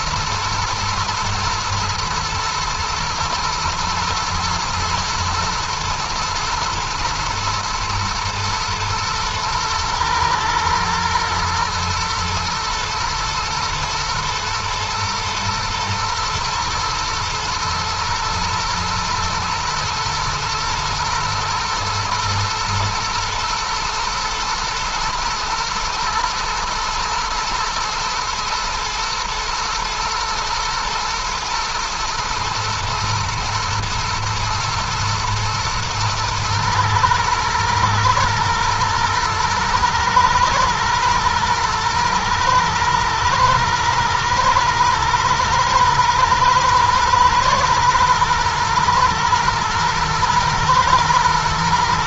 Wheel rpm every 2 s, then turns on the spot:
110, 110, 120, 120, 120, 120, 120, 120, 110, 120, 110, 110, 120, 120, 120, 120, 120, 110, 110, 110, 110, 110, 110, 120, 110, 110.
none